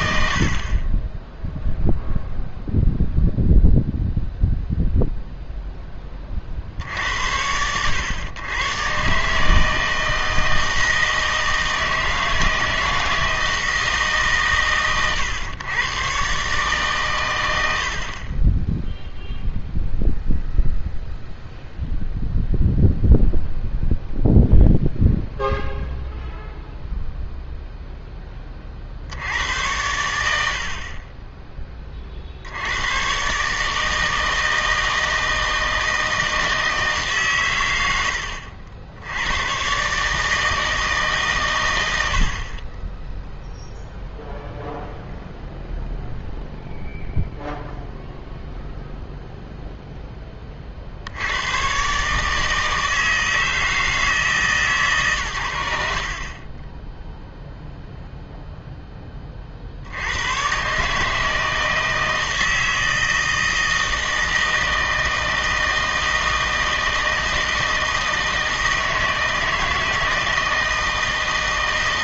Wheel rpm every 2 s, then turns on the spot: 30, 0, 0, 60, 120, 160, 160, 110, 140, 0, 0, 0, 0, 0, 50, 50, 100, 160, 160, 70, 150, 20, 0, 0, 0, 50, 160, 140, 10, 10, 140, 160, 160, 160, 160, 160.
none